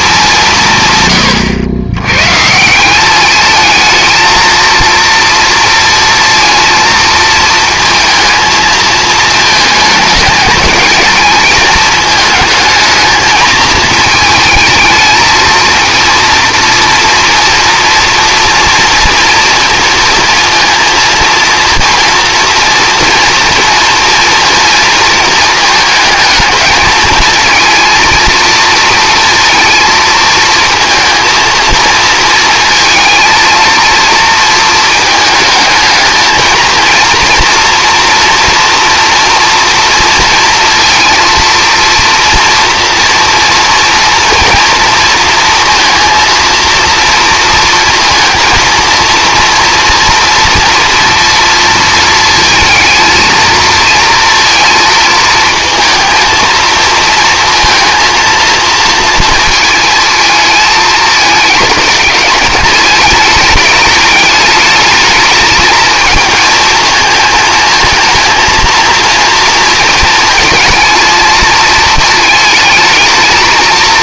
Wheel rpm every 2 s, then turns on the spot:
160, 170, 230, 230, 220, 220, 220, 220, 230, 230, 230, 230, 230, 220, 230, 230, 230, 230, 230, 230, 230, 230, 230, 230, 230, 230, 230, 230, 230, 230, 220, 210, 210, 220, 230, 220, 220.
none